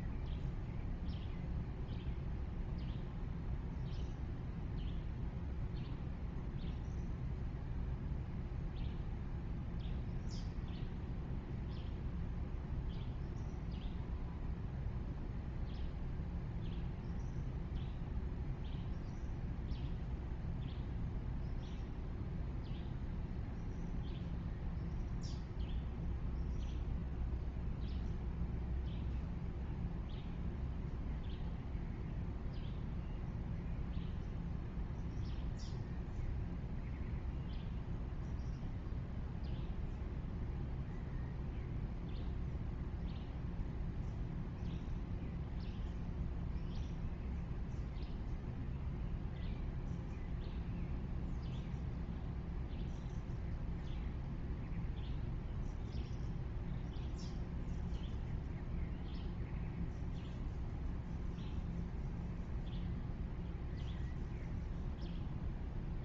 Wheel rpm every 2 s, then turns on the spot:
0, 0, 0, 0, 0, 0, 0, 0, 0, 0, 0, 0, 0, 0, 0, 0, 0, 0, 0, 0, 0, 0, 0, 0, 0, 0, 0, 0, 0, 0, 0, 0, 0.
none